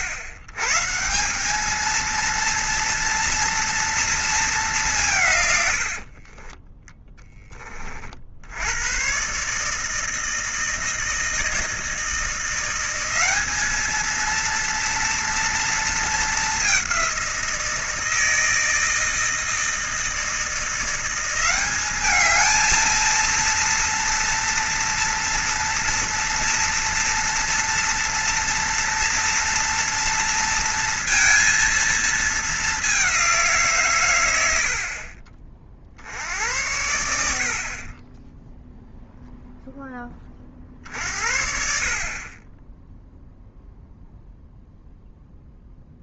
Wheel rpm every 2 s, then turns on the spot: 110, 230, 200, 20, 90, 160, 180, 230, 200, 160, 170, 220, 230, 230, 230, 230, 200, 70, 80, 0, 50, 10, 0.
6-8